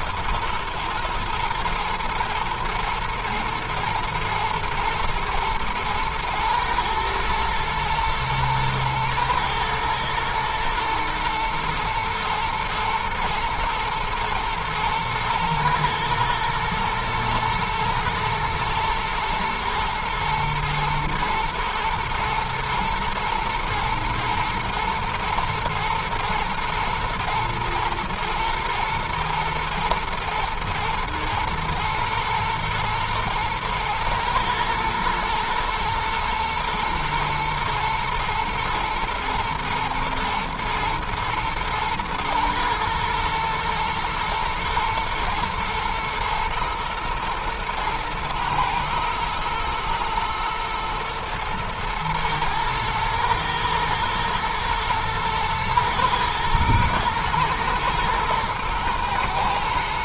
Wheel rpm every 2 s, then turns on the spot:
120, 110, 110, 120, 110, 110, 110, 110, 110, 120, 120, 120, 120, 110, 110, 110, 120, 110, 120, 110, 110, 110, 120, 110, 110, 120, 110, 110, 120, 110.
none